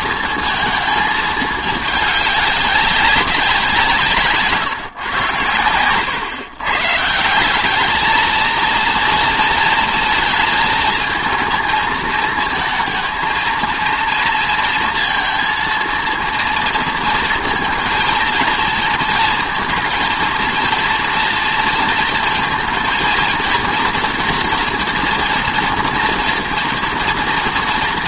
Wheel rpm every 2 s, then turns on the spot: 220, 200, 150, 140, 230, 220, 220, 230, 230, 230, 230, 230, 240, 230.
none